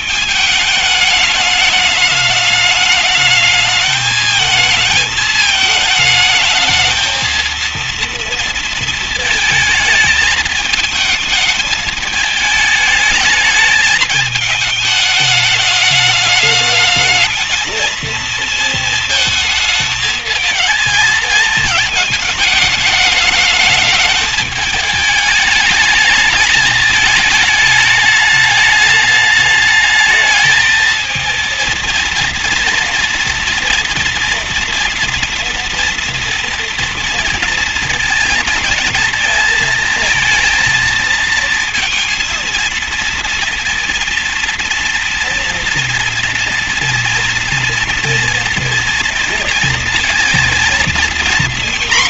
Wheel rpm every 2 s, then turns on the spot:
220, 210, 220, 220, 230, 220, 220, 210, 210, 230, 220, 220, 210, 220, 210, 220, 230, 240, 240, 230, 220, 230, 230, 230, 230, 240.
none